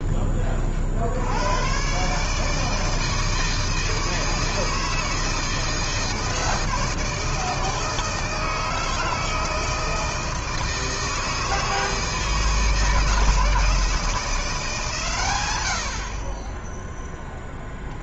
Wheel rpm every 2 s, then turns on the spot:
40, 150, 160, 160, 160, 160, 160, 150, 20.
none